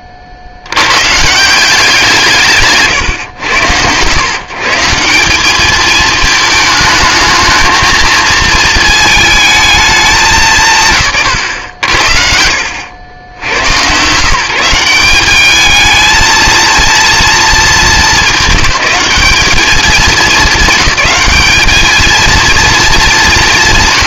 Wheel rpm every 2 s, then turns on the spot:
70, 150, 160, 220, 220, 140, 80, 180, 230, 210, 210, 220.
none